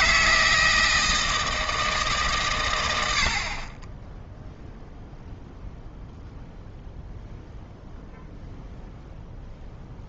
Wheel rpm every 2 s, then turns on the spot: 160, 100, 0, 0, 0.
none